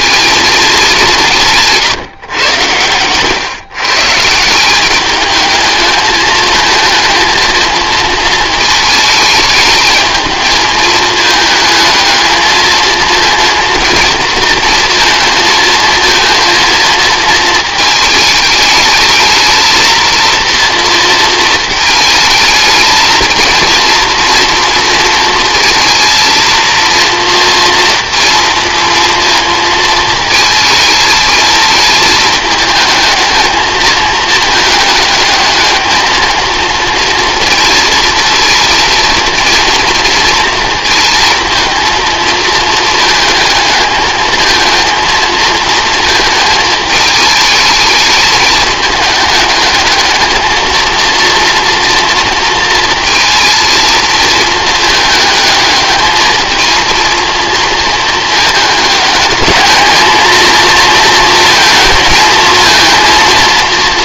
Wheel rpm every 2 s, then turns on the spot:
210, 110, 180, 220, 220, 220, 220, 230, 230, 210, 230, 220, 230, 230, 230, 220, 220, 210, 230, 230, 230, 220, 220, 220, 220, 220, 230, 220, 220, 220, 230, 220.
none